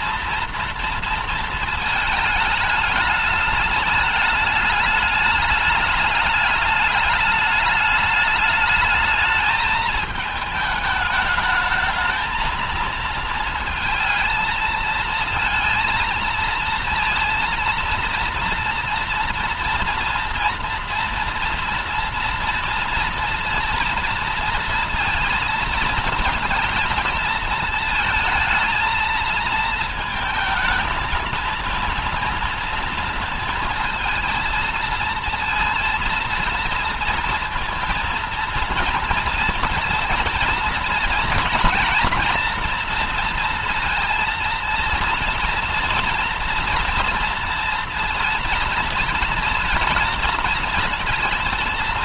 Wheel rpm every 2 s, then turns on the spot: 230, 210, 210, 210, 210, 220, 220, 220, 230, 230, 230, 230, 230, 230, 230, 220, 230, 230, 230, 230, 230, 230, 230, 230, 230, 220.
none